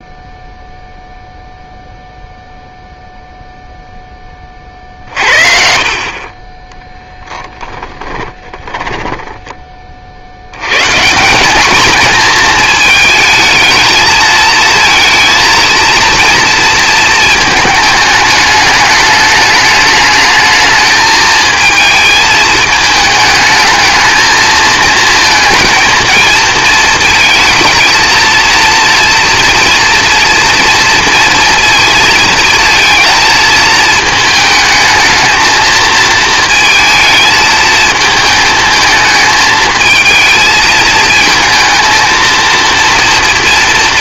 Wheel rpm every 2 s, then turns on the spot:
0, 0, 30, 20, 20, 100, 220, 220, 220, 210, 210, 220, 220, 220, 230, 230, 230, 220, 220, 220, 220, 230.
8-10